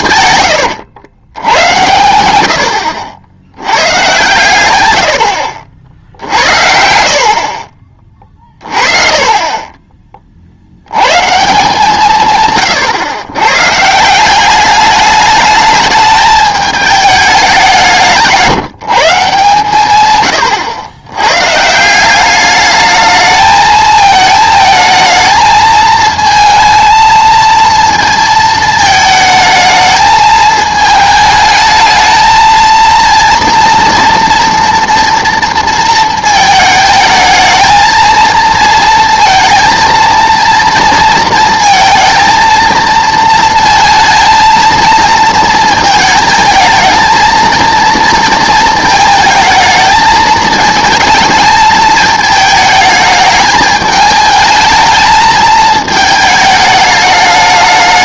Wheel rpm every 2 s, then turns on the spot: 120, 90, 110, 70, 40, 60, 130, 200, 210, 170, 100, 210, 220, 230, 220, 220, 230, 230, 220, 230, 230, 230, 230, 220, 220, 220, 220, 220, 210.
0-2 6-8